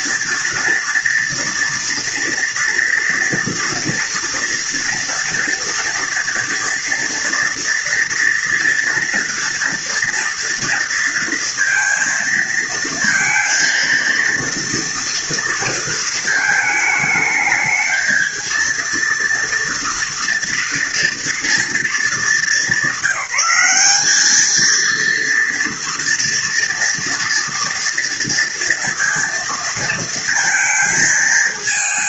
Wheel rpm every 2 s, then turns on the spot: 230, 230, 230, 230, 230, 230, 230, 230, 220, 230, 230, 210, 220, 230, 230, 230.
none